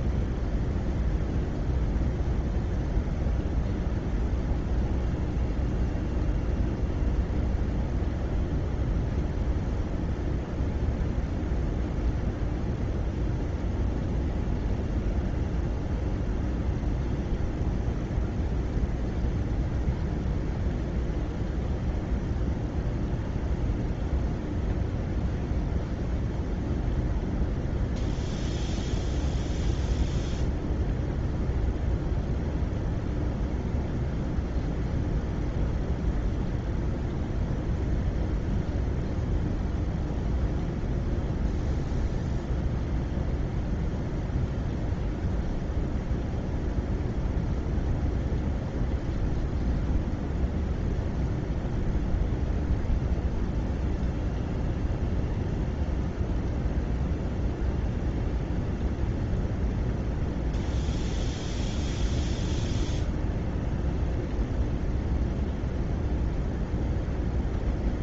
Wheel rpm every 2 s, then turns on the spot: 0, 0, 0, 0, 0, 0, 0, 0, 0, 0, 0, 0, 0, 0, 0, 0, 0, 0, 0, 0, 0, 0, 0, 0, 0, 0, 0, 0, 0, 0, 0, 0, 0, 0.
none